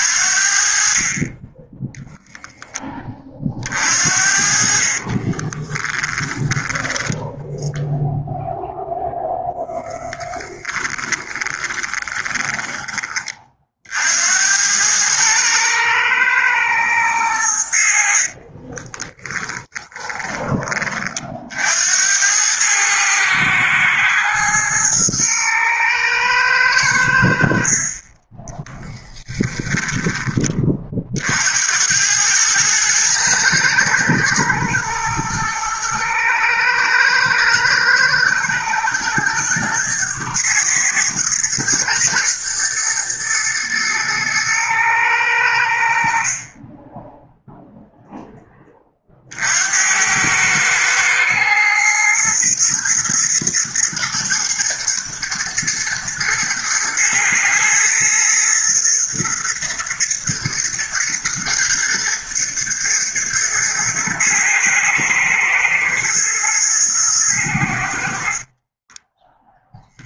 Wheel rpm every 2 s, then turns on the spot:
50, 30, 30, 10, 0, 20, 20, 110, 100, 20, 40, 110, 110, 80, 10, 50, 110, 120, 110, 110, 110, 120, 100, 10, 30, 110, 110, 110, 120, 110, 120, 120, 110, 110, 10.
4-6 10-12 18-20 28-30 68-70